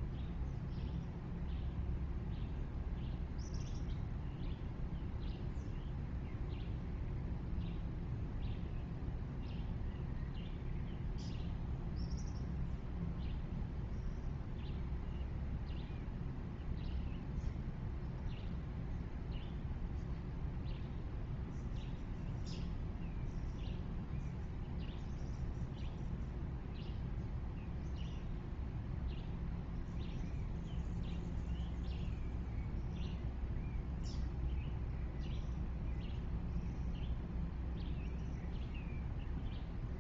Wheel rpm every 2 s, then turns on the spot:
0, 0, 0, 0, 0, 0, 0, 0, 0, 0, 0, 0, 0, 0, 0, 0, 0, 0, 0, 0.
none